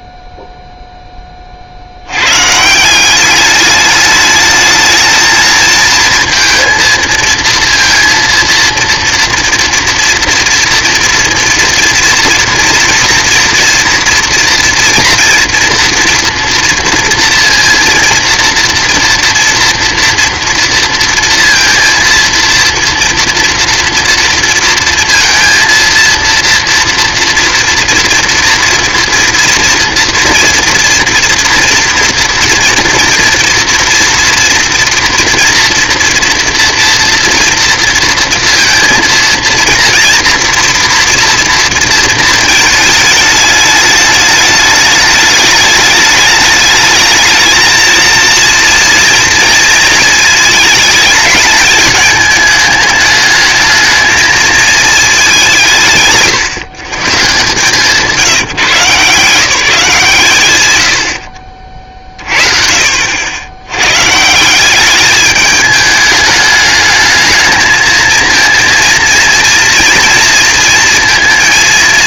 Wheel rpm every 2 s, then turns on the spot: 0, 170, 220, 230, 230, 240, 230, 230, 230, 230, 230, 230, 230, 240, 240, 230, 230, 230, 230, 230, 230, 220, 210, 210, 230, 220, 210, 220, 150, 170, 120, 50, 200, 210, 230, 230.
none